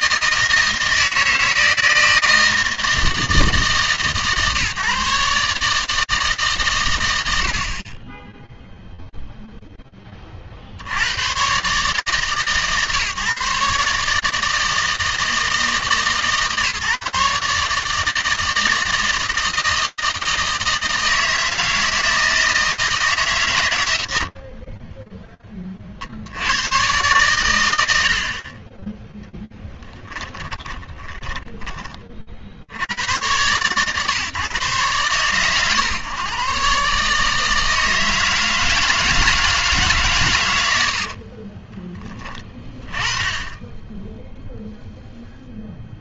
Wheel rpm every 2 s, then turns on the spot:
160, 160, 150, 140, 0, 80, 150, 160, 150, 160, 160, 160, 50, 110, 10, 20, 90, 130, 140, 160, 70, 30, 0.
30-32 40-42